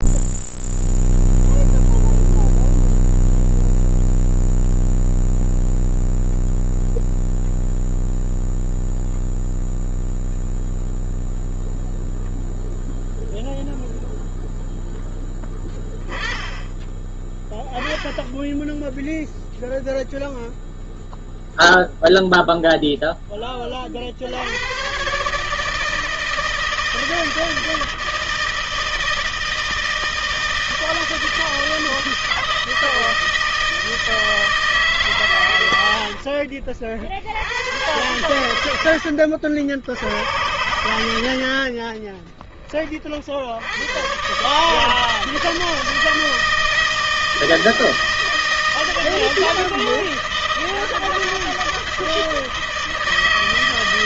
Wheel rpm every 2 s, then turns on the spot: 0, 0, 0, 0, 0, 0, 0, 10, 10, 0, 0, 0, 120, 160, 160, 160, 160, 150, 60, 90, 80, 40, 150, 160, 160, 160, 160.
38-40